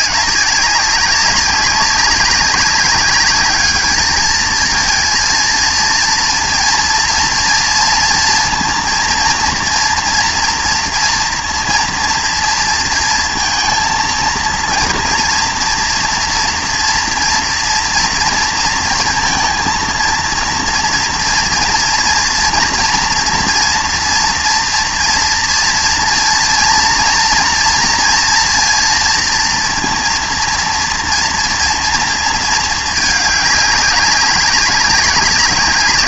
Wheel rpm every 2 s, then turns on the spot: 190, 200, 220, 230, 230, 240, 230, 230, 230, 230, 230, 230, 230, 230, 230, 230, 220, 200.
none